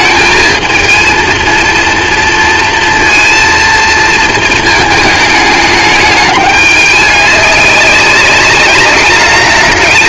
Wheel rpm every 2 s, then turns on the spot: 220, 230, 220, 210, 200.
none